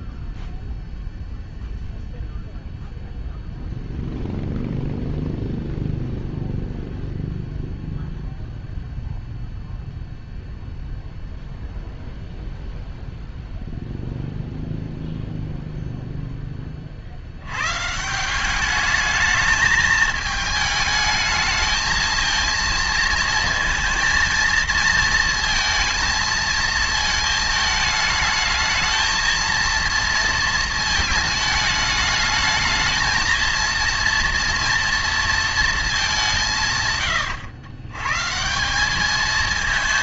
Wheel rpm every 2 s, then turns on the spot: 0, 0, 0, 0, 0, 0, 0, 0, 40, 210, 210, 230, 230, 220, 220, 220, 220, 230, 120, 190.
none